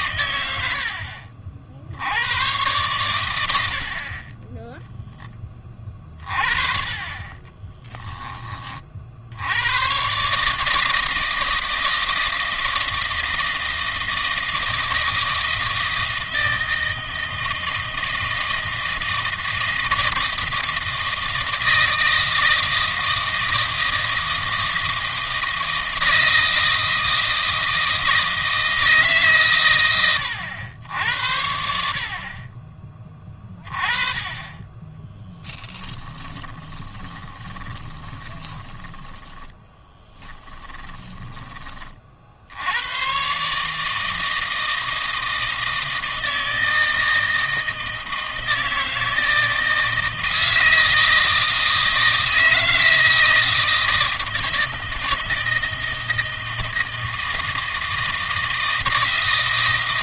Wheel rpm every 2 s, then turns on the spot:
70, 110, 10, 30, 50, 150, 160, 160, 160, 160, 160, 160, 160, 160, 160, 90, 30, 20, 30, 10, 10, 100, 160, 160, 160, 160, 160, 160, 160, 160.
6-8 34-42